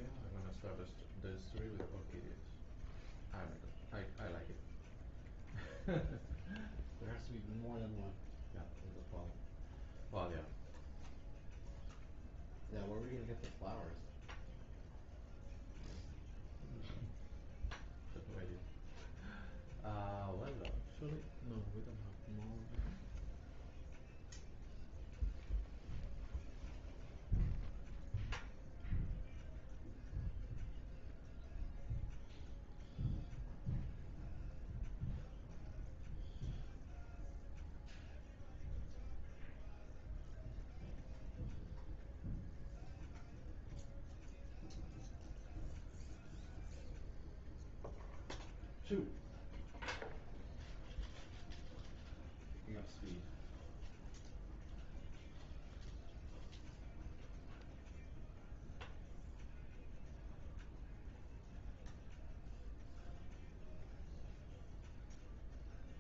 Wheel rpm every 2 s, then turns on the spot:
0, 0, 0, 0, 0, 0, 0, 0, 0, 0, 0, 0, 0, 0, 0, 0, 0, 0, 0, 0, 0, 0, 0, 0, 0, 0, 0, 0, 0, 0, 0, 0, 0.
none